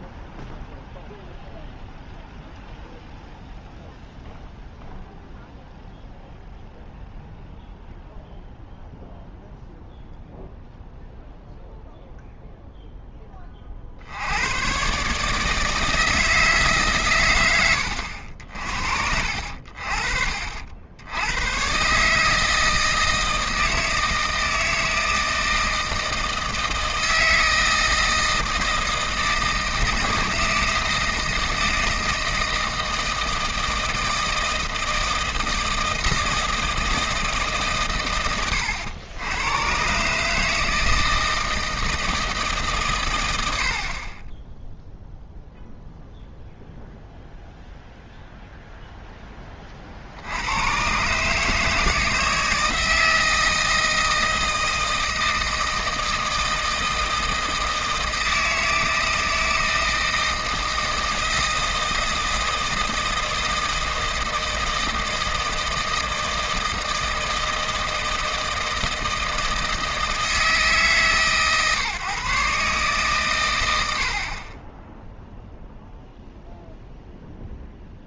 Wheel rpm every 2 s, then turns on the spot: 0, 0, 0, 0, 0, 0, 0, 120, 150, 50, 70, 160, 160, 160, 160, 160, 160, 160, 160, 100, 160, 140, 0, 0, 0, 110, 160, 160, 160, 160, 160, 160, 160, 160, 160, 160, 140, 20, 0.
none